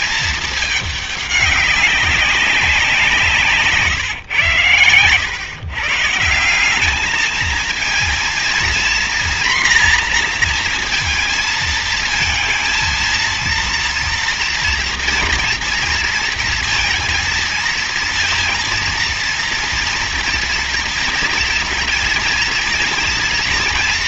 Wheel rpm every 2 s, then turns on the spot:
210, 180, 100, 180, 240, 240, 220, 230, 230, 230, 230, 230.
none